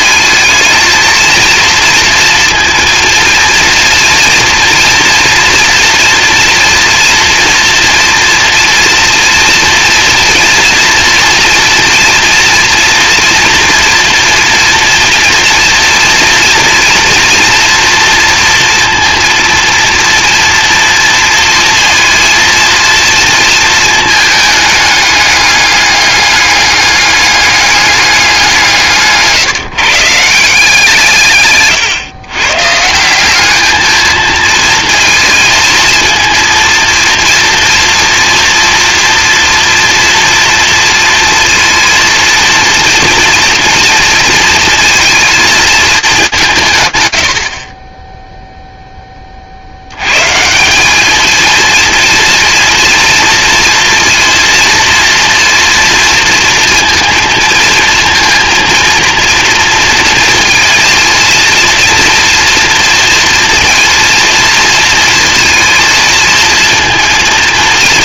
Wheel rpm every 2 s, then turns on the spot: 220, 230, 230, 230, 240, 230, 230, 230, 230, 230, 230, 230, 210, 200, 170, 160, 160, 220, 230, 230, 230, 240, 230, 150, 0, 190, 240, 230, 230, 230, 230, 230, 230, 230.
28-30